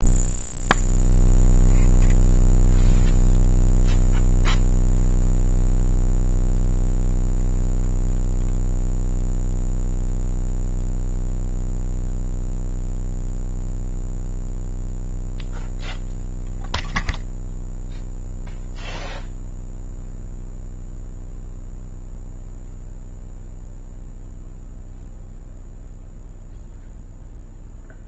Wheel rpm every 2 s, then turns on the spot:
0, 0, 0, 0, 0, 0, 0, 0, 0, 0, 0, 0, 0, 0.
none